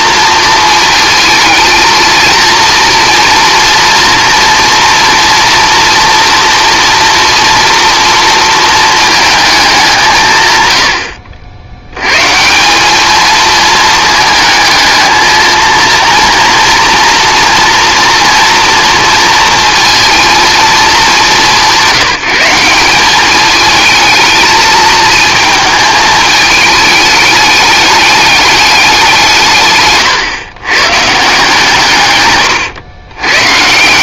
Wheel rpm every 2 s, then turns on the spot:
230, 230, 240, 230, 230, 110, 190, 220, 230, 230, 230, 190, 220, 210, 200, 130, 110.
none